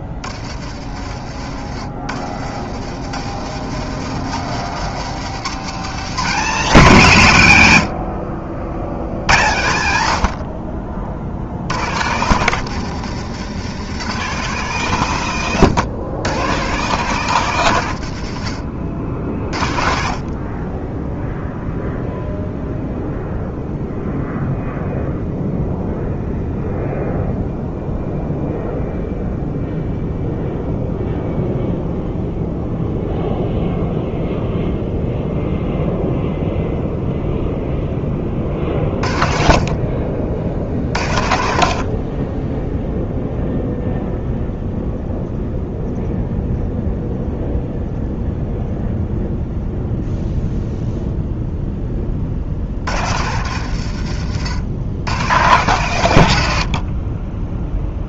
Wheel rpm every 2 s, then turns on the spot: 50, 80, 130, 200, 70, 60, 130, 150, 140, 70, 30, 0, 0, 0, 0, 0, 0, 0, 0, 40, 60, 10, 0, 0, 0, 0, 60, 90, 80.
54-56